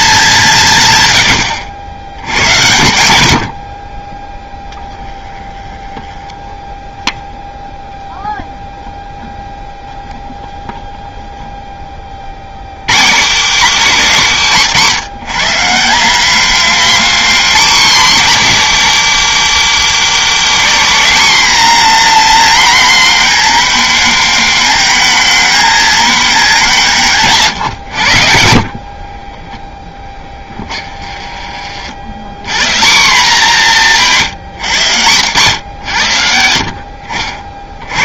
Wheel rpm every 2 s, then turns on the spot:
140, 90, 10, 0, 0, 0, 110, 150, 240, 200, 220, 240, 230, 190, 50, 30, 170, 110, 70.
4-6 28-32